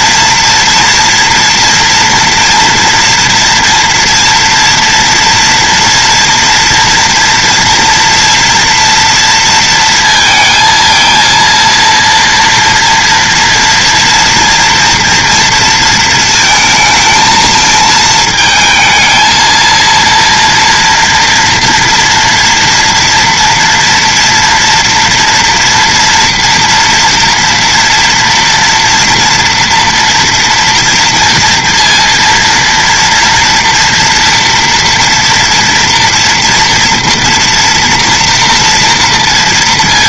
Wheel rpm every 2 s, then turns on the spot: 230, 230, 230, 230, 240, 230, 230, 230, 230, 220, 230, 240, 230, 230, 230, 240, 230, 230, 230, 230.
none